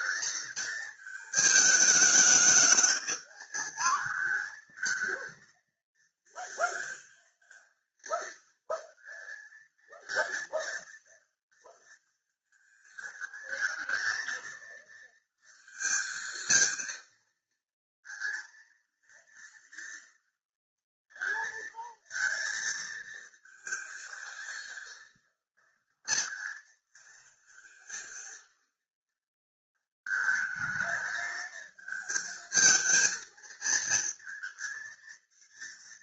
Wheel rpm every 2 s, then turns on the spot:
220, 210, 220, 230, 220, 230, 230, 230, 230, 230, 230, 230, 230, 230, 230, 220, 220, 230.
none